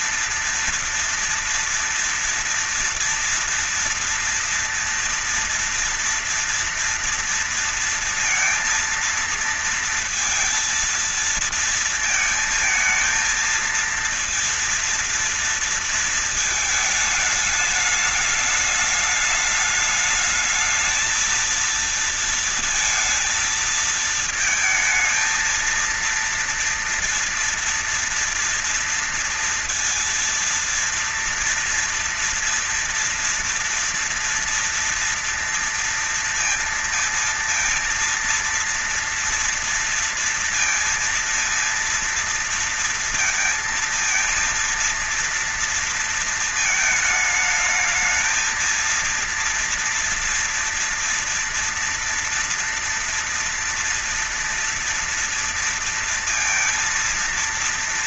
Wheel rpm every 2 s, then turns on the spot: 230, 230, 230, 230, 230, 230, 220, 230, 220, 210, 220, 230, 220, 230, 230, 230, 230, 230, 230, 230, 230, 230, 230, 230, 220, 230, 230, 230, 230.
none